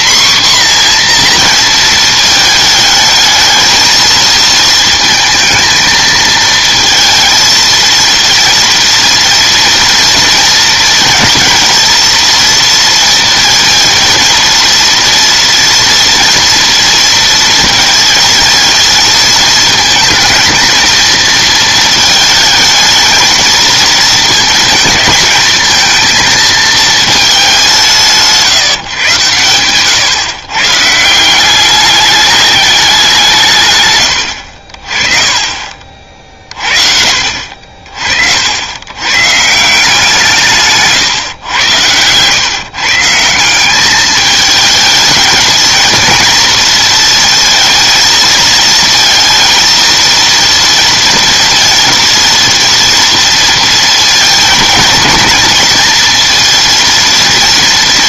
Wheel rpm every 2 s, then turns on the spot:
250, 220, 220, 220, 230, 230, 230, 230, 230, 220, 220, 210, 220, 220, 150, 150, 200, 60, 40, 80, 150, 140, 220, 230, 220, 230, 230, 220, 230.
none